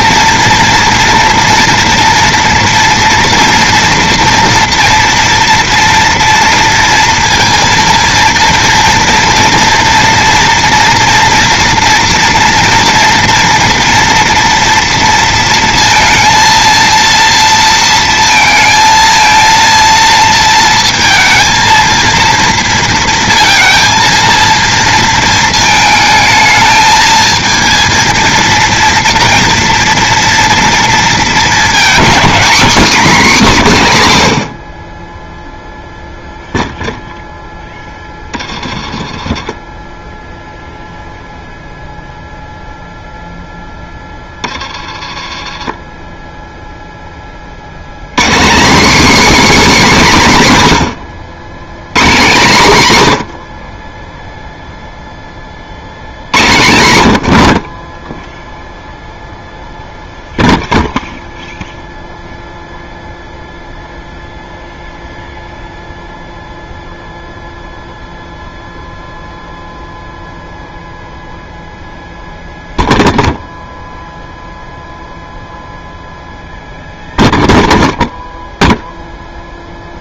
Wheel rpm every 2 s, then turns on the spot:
230, 230, 230, 230, 230, 230, 230, 230, 230, 230, 230, 230, 230, 220, 230, 230, 270, 70, 0, 30, 0, 0, 20, 0, 220, 160, 160, 0, 120, 0, 0, 0, 0, 0, 0, 0, 0, 0, 0, 0.
38-40 44-46